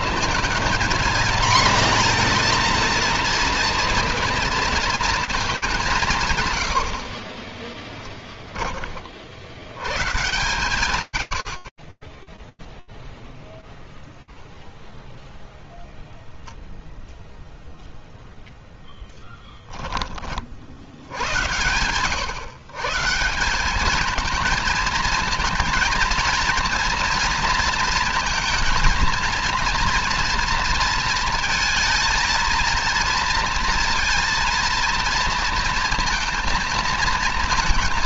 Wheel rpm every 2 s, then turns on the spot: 230, 230, 230, 70, 30, 110, 0, 0, 0, 10, 110, 200, 230, 230, 230, 220, 230, 230, 230.
6-8